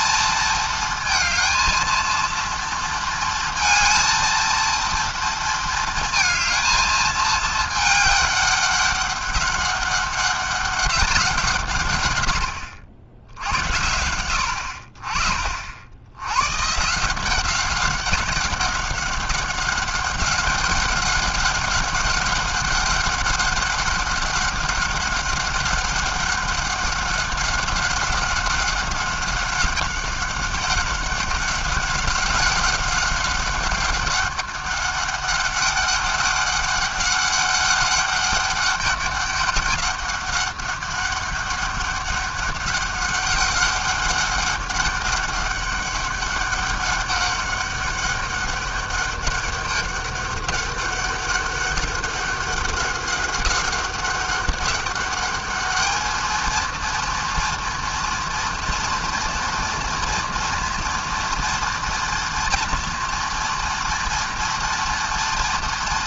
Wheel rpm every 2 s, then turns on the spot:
220, 230, 230, 220, 200, 200, 90, 50, 160, 190, 190, 200, 200, 200, 200, 190, 190, 200, 200, 200, 190, 200, 200, 200, 200, 200, 200, 200, 230, 240, 230, 230, 230.
none